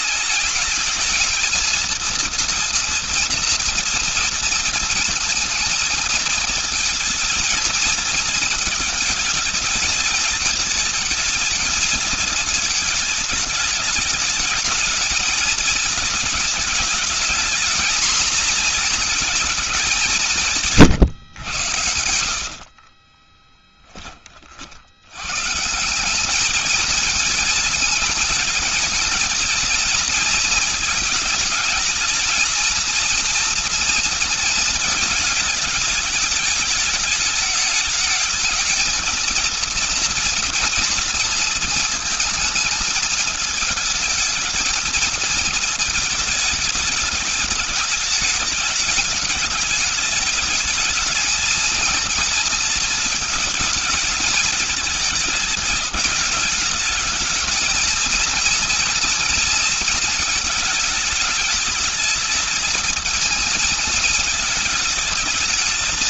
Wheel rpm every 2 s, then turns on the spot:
210, 230, 230, 220, 220, 220, 220, 220, 210, 230, 160, 50, 50, 210, 220, 220, 230, 230, 210, 220, 240, 220, 220, 220, 210, 210, 230, 220, 220, 230, 220, 220, 220.
22-24